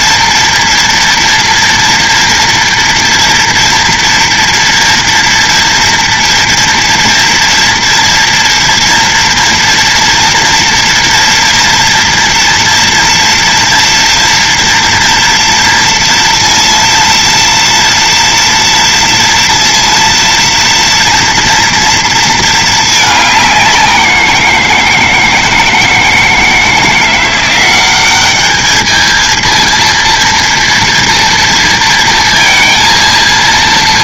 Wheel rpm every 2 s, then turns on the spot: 230, 230, 230, 230, 230, 230, 230, 240, 230, 230, 230, 220, 170, 160, 210, 230, 230.
none